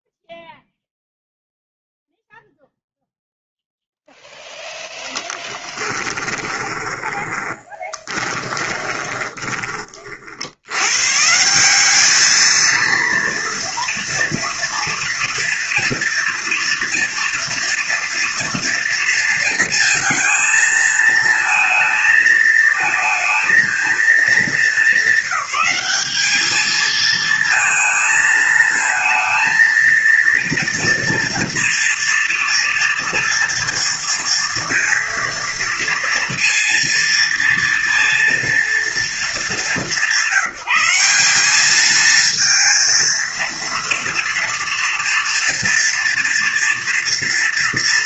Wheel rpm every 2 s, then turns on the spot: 0, 0, 0, 30, 20, 90, 230, 230, 230, 230, 220, 220, 200, 220, 220, 230, 230, 230, 230, 230, 170, 230, 240, 230.
6-10